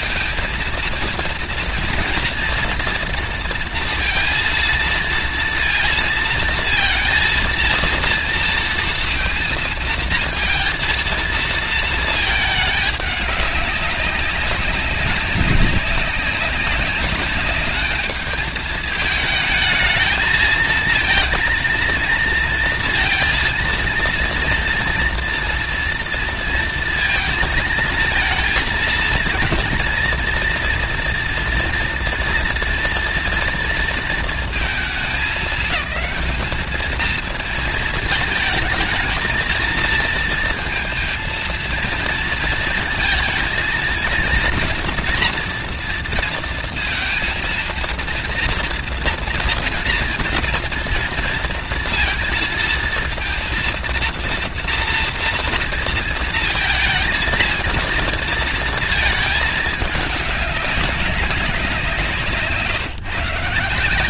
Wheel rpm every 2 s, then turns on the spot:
220, 230, 230, 230, 230, 230, 210, 190, 200, 220, 220, 230, 230, 230, 230, 230, 230, 220, 220, 220, 230, 230, 240, 230, 230, 230, 230, 230, 230, 230, 200, 160.
none